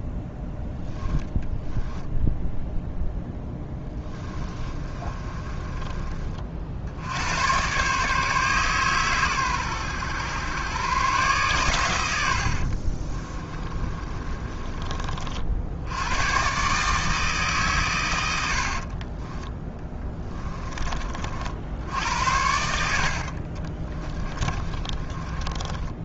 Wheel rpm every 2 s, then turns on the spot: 10, 10, 30, 70, 130, 120, 50, 30, 150, 50, 30, 70, 30.
0-2 4-6 12-14 18-20 22-26